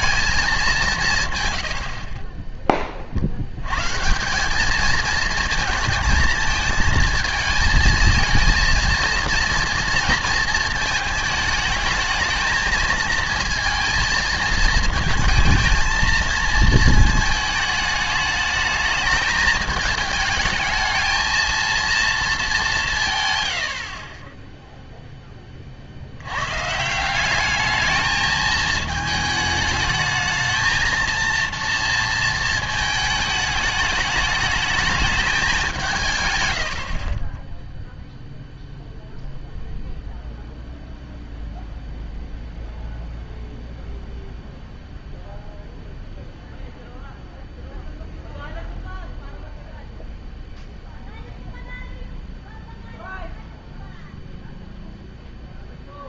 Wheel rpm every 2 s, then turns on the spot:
200, 20, 200, 220, 230, 220, 220, 220, 230, 220, 220, 210, 10, 130, 220, 220, 220, 210, 110, 0, 0, 0, 0, 0, 0, 0, 0, 0.
none